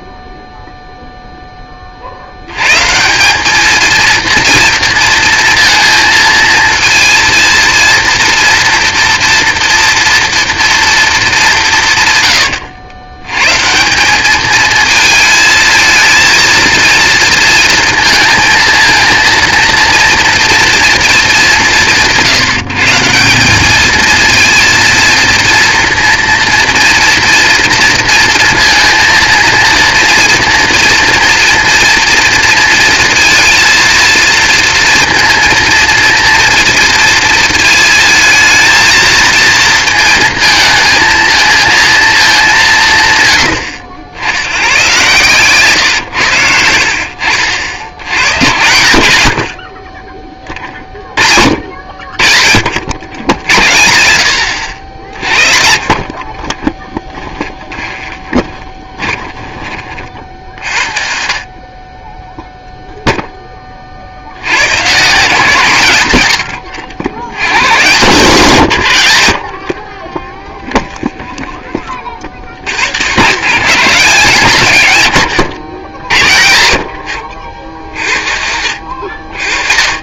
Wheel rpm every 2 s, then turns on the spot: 0, 100, 230, 230, 230, 240, 80, 210, 230, 230, 230, 150, 230, 230, 230, 240, 230, 230, 230, 230, 230, 180, 100, 90, 80, 30, 60, 60, 30, 20, 50, 0, 100, 90, 130, 10, 70, 140, 80, 60.
56-60 70-72